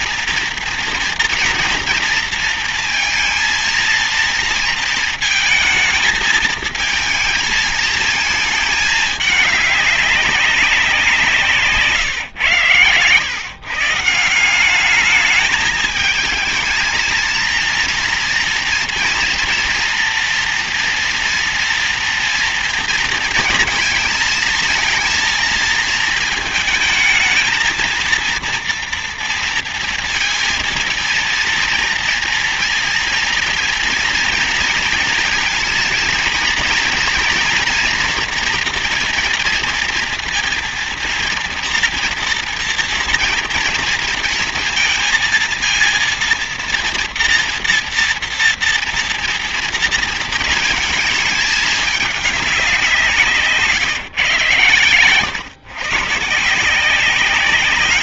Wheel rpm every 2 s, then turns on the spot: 240, 230, 230, 220, 220, 200, 130, 170, 220, 230, 240, 230, 230, 220, 230, 230, 230, 230, 230, 240, 230, 230, 230, 230, 230, 220, 200, 130, 160.
none